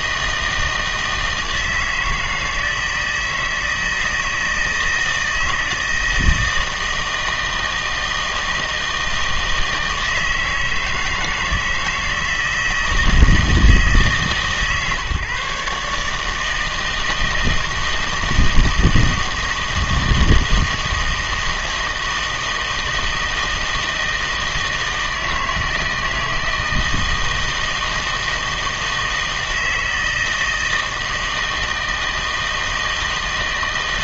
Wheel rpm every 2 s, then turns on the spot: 160, 160, 160, 160, 160, 160, 160, 150, 160, 160, 160, 160, 160, 160, 160, 160, 160.
none